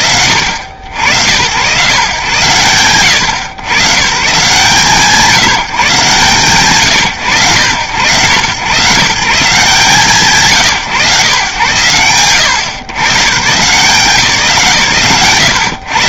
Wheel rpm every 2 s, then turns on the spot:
90, 80, 150, 130, 150, 120, 140, 110.
none